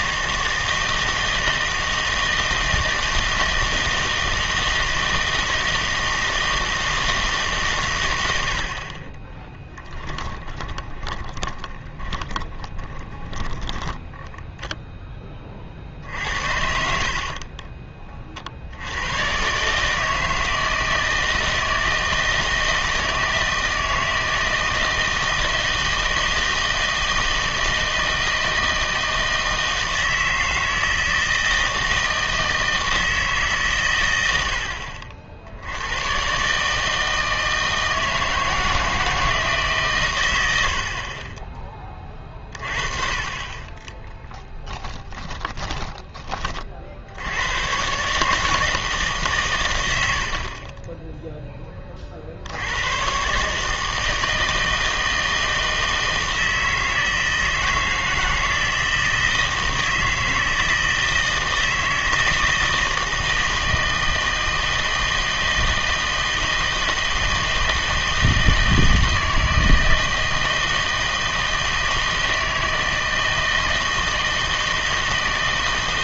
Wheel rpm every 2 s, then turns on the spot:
160, 160, 160, 160, 60, 30, 20, 0, 70, 70, 160, 160, 160, 160, 160, 160, 160, 70, 160, 160, 70, 30, 20, 40, 150, 30, 80, 160, 160, 160, 160, 160, 160, 160, 160, 160, 160, 160.
10-14 40-42 44-46